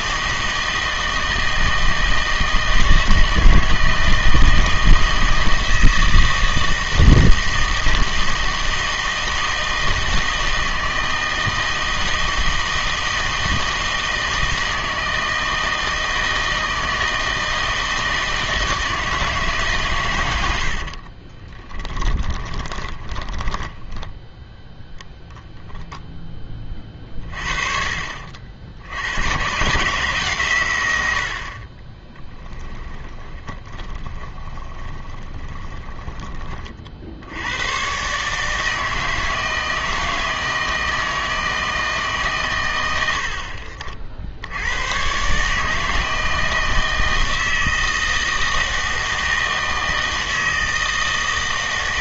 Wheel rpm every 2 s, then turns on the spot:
160, 160, 160, 160, 160, 160, 160, 160, 160, 160, 70, 20, 0, 20, 80, 120, 20, 20, 40, 160, 160, 110, 80, 160, 160, 160.
20-24 32-36